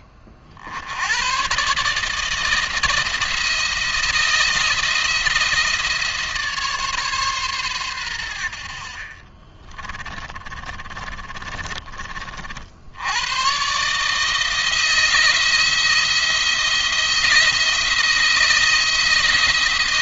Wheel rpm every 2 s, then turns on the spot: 30, 160, 170, 150, 70, 30, 60, 160, 170, 160.
10-12